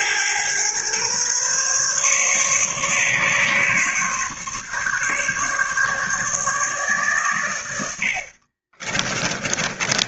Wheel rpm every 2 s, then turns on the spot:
120, 140, 140, 140, 30.
8-10